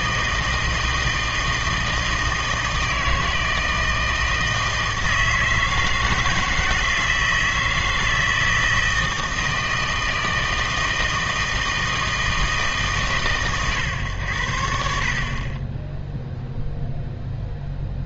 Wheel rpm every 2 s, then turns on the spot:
160, 160, 160, 160, 160, 160, 160, 80, 0.
none